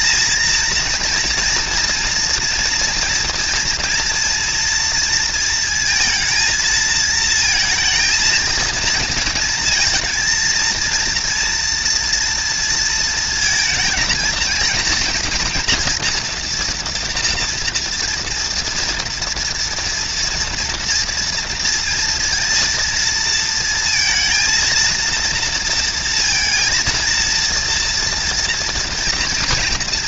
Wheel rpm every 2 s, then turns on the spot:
230, 230, 230, 230, 230, 230, 230, 230, 240, 230, 230, 230, 230, 230, 230.
none